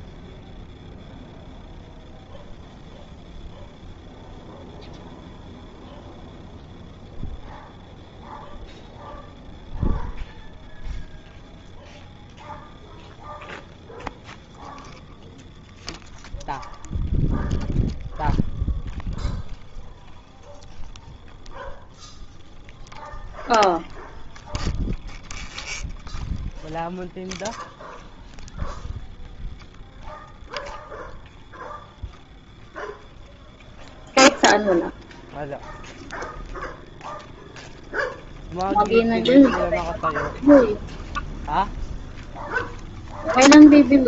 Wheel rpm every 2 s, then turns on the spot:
0, 0, 0, 0, 0, 0, 0, 0, 0, 0, 0, 0, 0, 0, 0, 0, 0, 0, 0, 0, 0, 0.
none